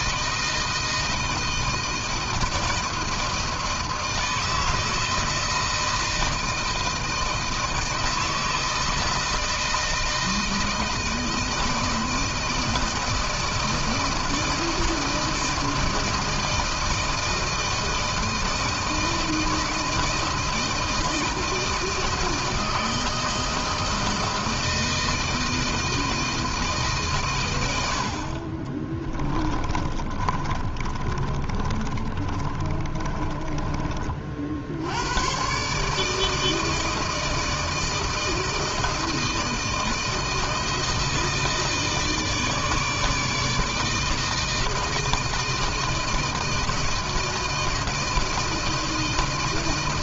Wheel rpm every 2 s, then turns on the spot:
160, 160, 160, 160, 160, 160, 160, 160, 160, 160, 160, 160, 160, 130, 20, 30, 30, 90, 160, 160, 160, 160, 160, 160, 160.
28-34